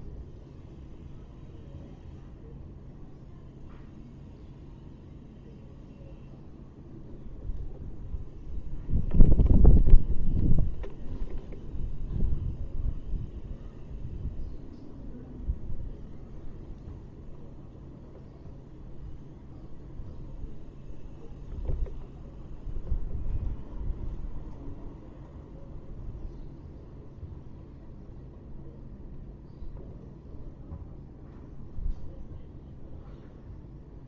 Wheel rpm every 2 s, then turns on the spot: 0, 0, 0, 0, 0, 0, 0, 0, 0, 0, 0, 0, 0, 0, 0, 0, 0.
none